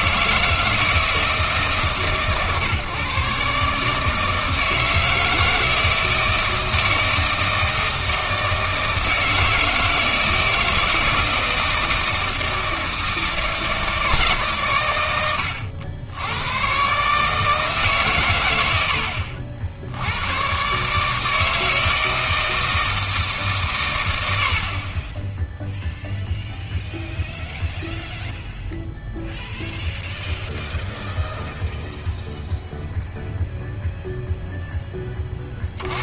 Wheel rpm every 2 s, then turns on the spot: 160, 140, 160, 160, 160, 160, 160, 120, 120, 100, 130, 160, 40, 0, 0, 0, 0, 10.
none